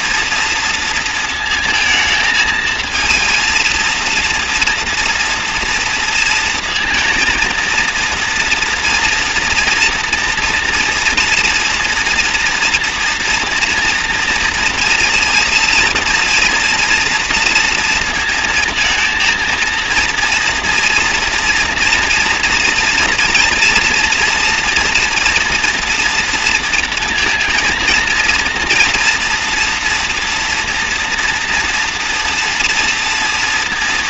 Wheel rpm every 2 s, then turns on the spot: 230, 230, 230, 230, 230, 230, 230, 230, 230, 230, 240, 240, 230, 230, 240, 230, 230.
none